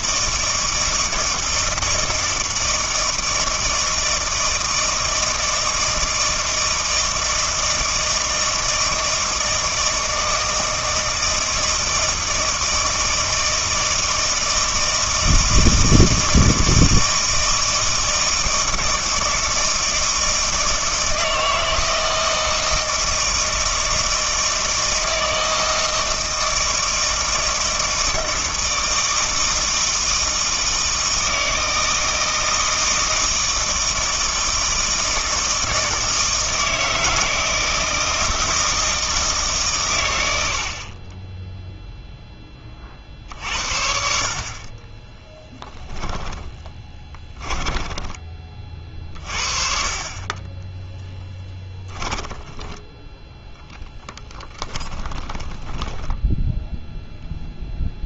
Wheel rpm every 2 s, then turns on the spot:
160, 160, 160, 160, 160, 160, 160, 160, 160, 160, 160, 160, 160, 160, 160, 160, 160, 160, 160, 160, 30, 40, 20, 20, 40, 10, 10, 10, 0.
44-48 54-56